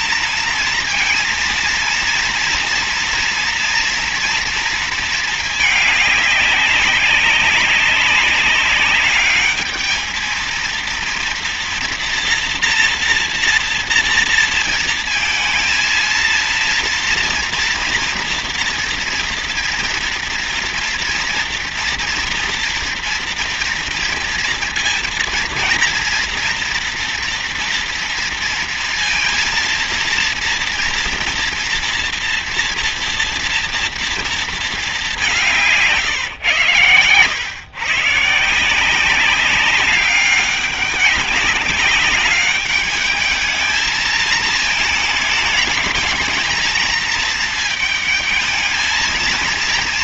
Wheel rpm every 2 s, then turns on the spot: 230, 230, 220, 200, 210, 230, 230, 230, 230, 230, 230, 230, 230, 230, 230, 230, 230, 210, 120, 180, 200, 210, 220, 220, 220.
none